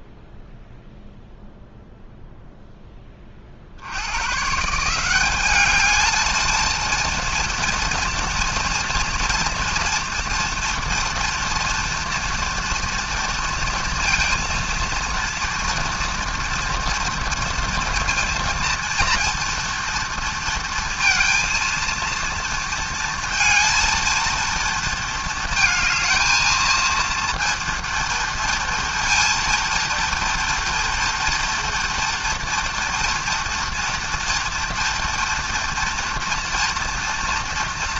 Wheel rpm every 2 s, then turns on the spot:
0, 0, 140, 230, 230, 230, 230, 230, 230, 230, 230, 230, 230, 220, 230, 240, 230, 230, 230.
none